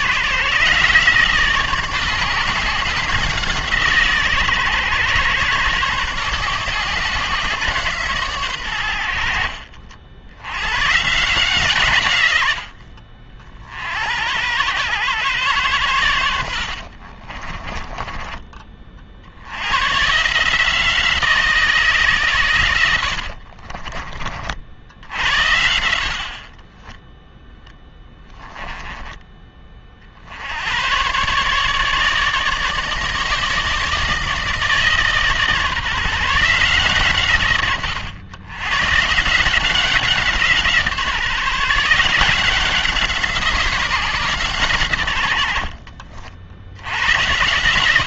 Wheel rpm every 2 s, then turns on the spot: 150, 160, 120, 140, 100, 120, 90, 100, 60, 40, 160, 90, 60, 20, 20, 100, 150, 160, 150, 110, 160, 180, 130, 70.
16-18 26-30